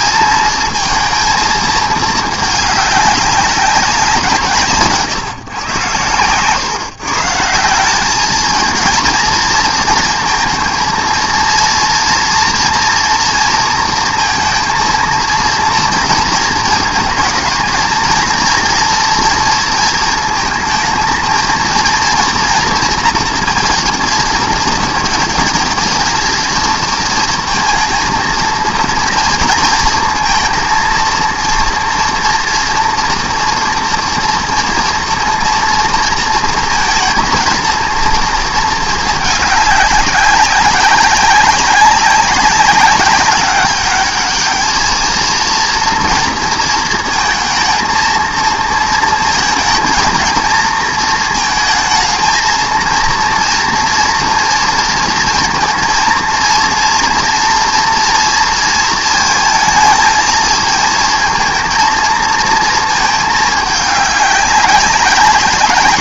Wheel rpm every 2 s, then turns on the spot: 220, 210, 150, 150, 220, 220, 230, 230, 220, 230, 220, 230, 230, 230, 230, 230, 230, 230, 220, 220, 200, 200, 220, 230, 230, 230, 230, 230, 230, 230, 220, 230, 200.
none